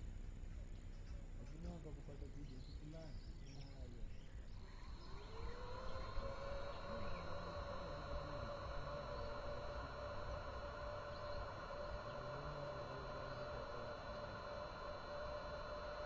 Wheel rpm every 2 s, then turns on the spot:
0, 0, 0, 0, 0, 0, 0, 0.
none